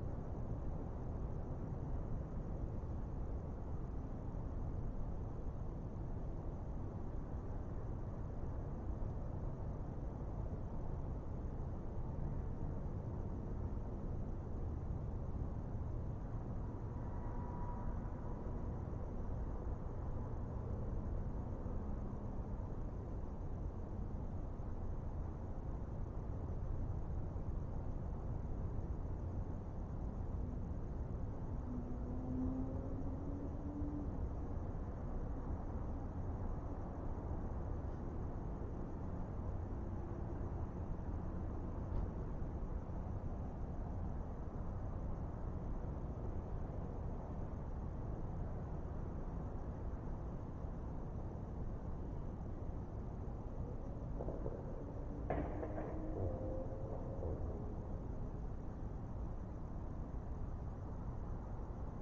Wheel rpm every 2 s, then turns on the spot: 0, 0, 0, 0, 0, 0, 0, 0, 0, 0, 0, 0, 0, 0, 0, 0, 0, 0, 0, 0, 0, 0, 0, 0, 0, 0, 0, 0, 0, 0, 0.
none